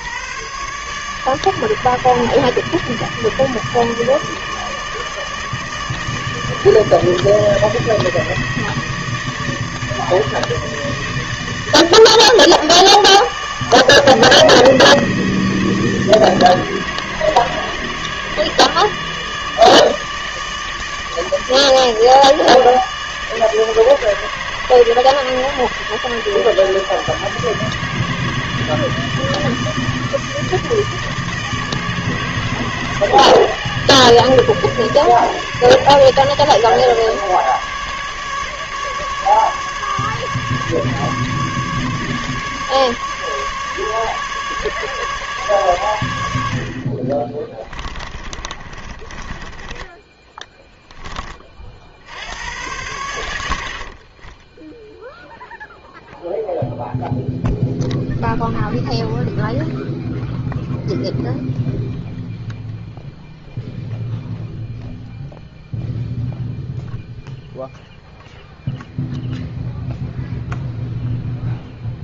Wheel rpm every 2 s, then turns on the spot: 140, 160, 150, 160, 160, 150, 150, 160, 150, 150, 150, 160, 160, 160, 150, 150, 150, 150, 150, 150, 150, 150, 150, 70, 30, 10, 100, 10, 0, 0, 0, 0, 0, 0, 0, 0.
48-50